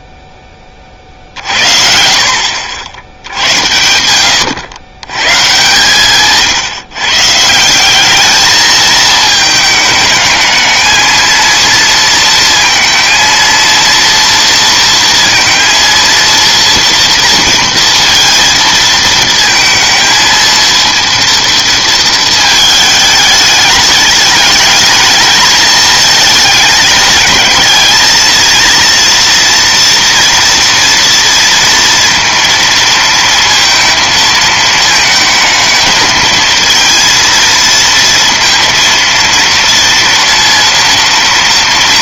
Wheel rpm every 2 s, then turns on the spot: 50, 80, 120, 170, 220, 230, 230, 230, 230, 230, 230, 210, 220, 220, 240, 230, 230, 220, 220, 230, 230.
none